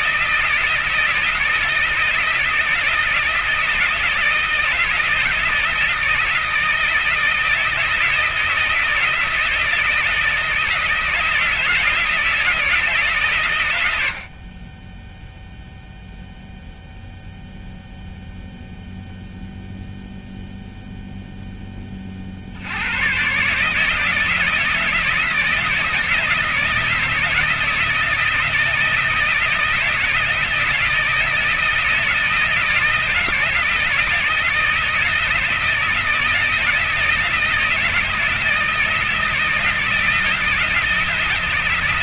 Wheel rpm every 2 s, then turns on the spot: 160, 160, 160, 160, 160, 160, 160, 50, 0, 0, 0, 70, 160, 160, 160, 160, 160, 160, 160, 160, 160.
none